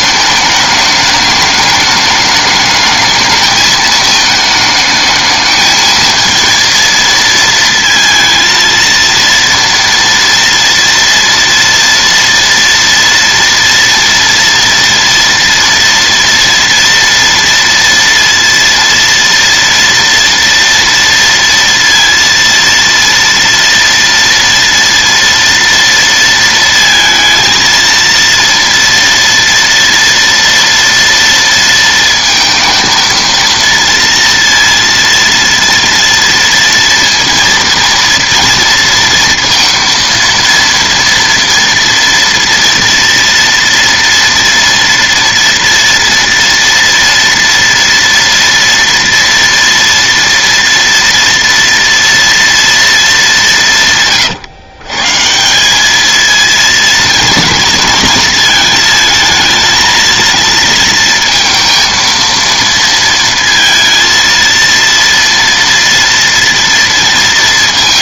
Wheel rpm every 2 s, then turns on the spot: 210, 210, 220, 230, 230, 230, 230, 230, 230, 230, 230, 230, 230, 230, 230, 230, 230, 230, 230, 230, 230, 230, 230, 230, 230, 240, 220, 140, 230, 220, 230, 230, 230, 230.
none